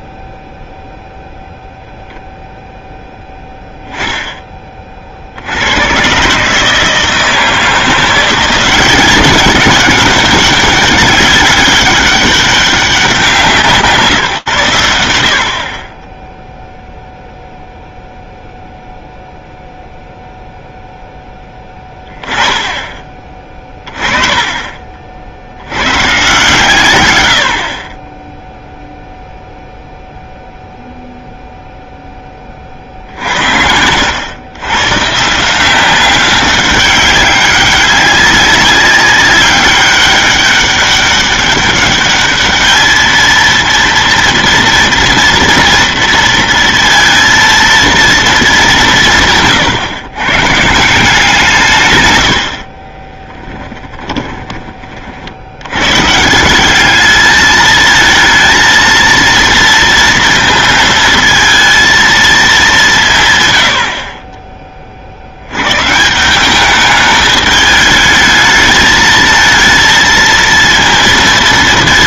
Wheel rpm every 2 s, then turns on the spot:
0, 0, 20, 150, 180, 200, 200, 110, 0, 0, 0, 10, 30, 140, 0, 0, 40, 120, 190, 190, 200, 210, 230, 230, 210, 140, 60, 30, 180, 220, 230, 210, 30, 190, 220, 230.
52-54